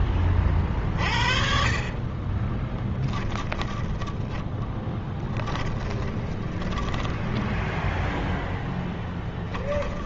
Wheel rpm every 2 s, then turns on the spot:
40, 10, 10, 10, 0.
2-8